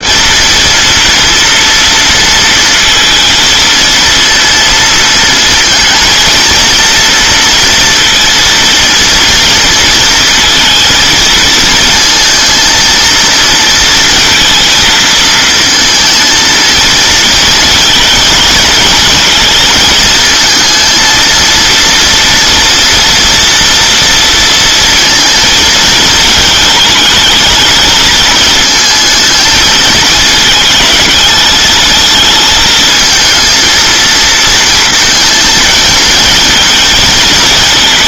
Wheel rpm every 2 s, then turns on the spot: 230, 230, 230, 230, 230, 230, 230, 220, 230, 220, 230, 240, 230, 220, 230, 220, 220, 230, 230.
none